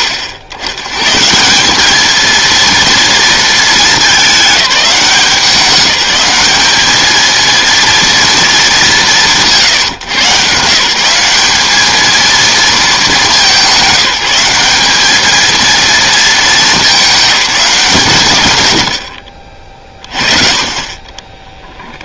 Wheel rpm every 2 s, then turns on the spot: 90, 230, 200, 210, 210, 150, 220, 200, 210, 120, 40.
none